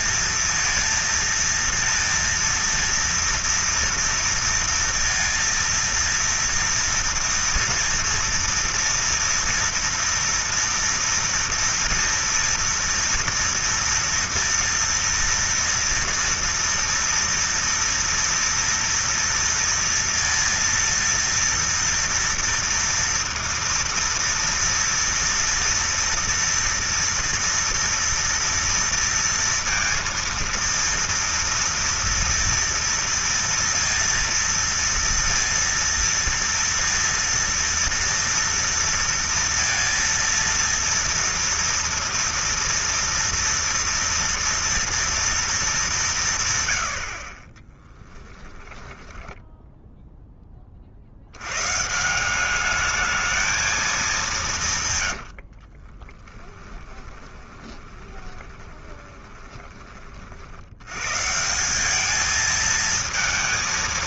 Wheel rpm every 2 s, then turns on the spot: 230, 230, 230, 230, 230, 230, 230, 230, 230, 240, 230, 230, 240, 230, 230, 230, 230, 230, 230, 230, 230, 230, 230, 120, 10, 40, 210, 150, 10, 20, 100, 220.
48-50 54-60